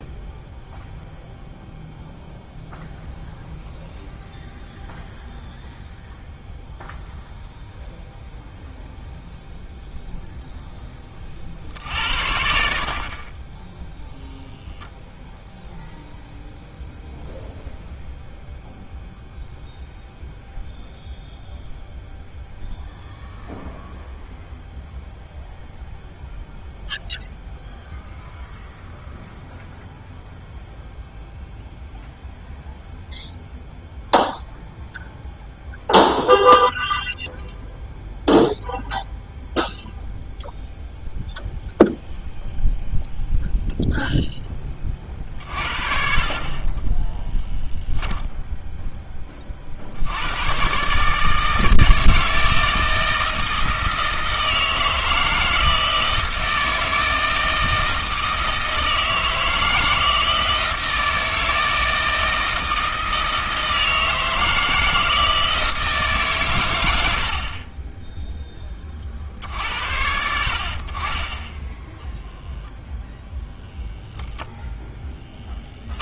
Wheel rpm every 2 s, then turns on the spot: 0, 0, 0, 0, 0, 10, 50, 10, 0, 0, 0, 0, 0, 0, 0, 0, 0, 0, 0, 0, 0, 0, 30, 20, 10, 130, 160, 160, 160, 160, 160, 160, 160, 100, 30, 50, 0, 0.
46-48